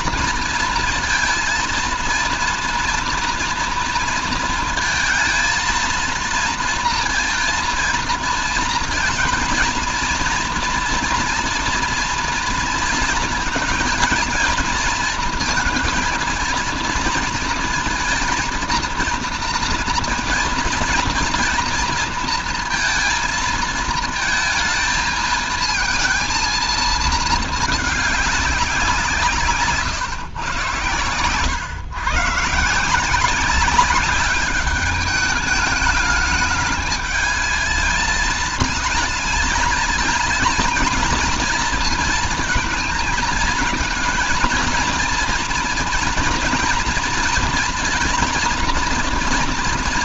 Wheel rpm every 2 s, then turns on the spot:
230, 230, 230, 220, 220, 230, 230, 230, 230, 230, 230, 230, 220, 220, 190, 130, 150, 200, 220, 220, 220, 220, 230, 230, 230.
none